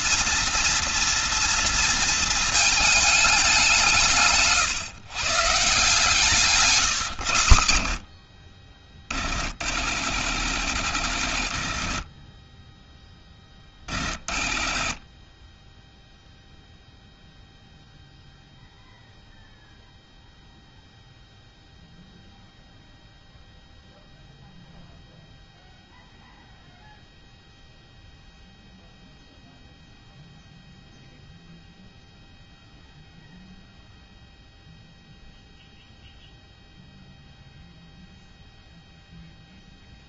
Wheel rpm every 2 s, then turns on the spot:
230, 210, 140, 120, 50, 80, 10, 30, 0, 0, 0, 0, 0, 0, 0, 0, 0, 0, 0, 0.
none